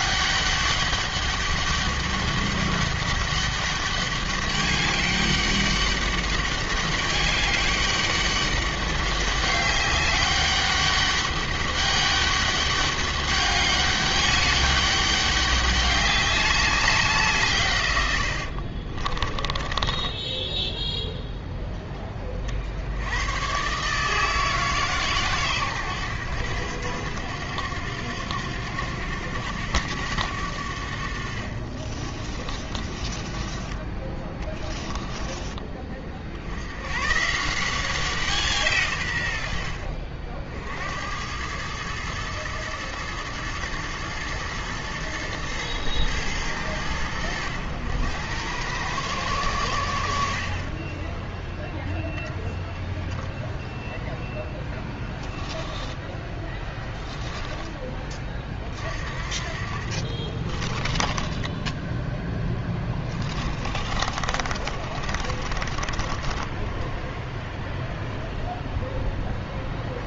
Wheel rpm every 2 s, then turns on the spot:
200, 200, 200, 200, 200, 200, 200, 200, 190, 50, 10, 60, 150, 90, 90, 80, 30, 10, 80, 150, 70, 110, 110, 100, 100, 40, 0, 10, 10, 40, 30, 10, 40, 10, 0.
18-20 32-36 54-58 60-68